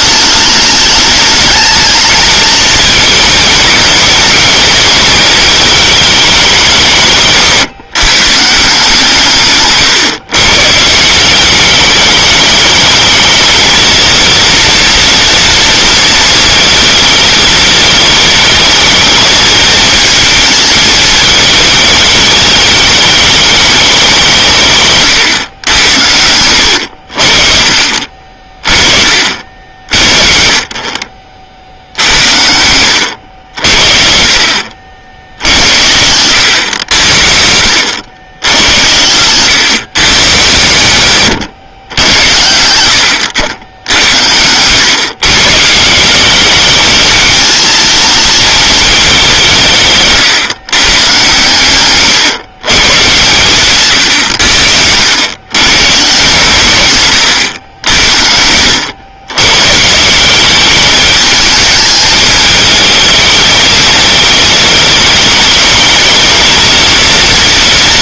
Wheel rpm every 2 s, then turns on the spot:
210, 220, 230, 190, 160, 140, 210, 230, 220, 220, 220, 210, 170, 90, 30, 40, 80, 60, 90, 90, 120, 90, 100, 200, 220, 130, 130, 90, 140, 90, 200, 220, 220, 230.
none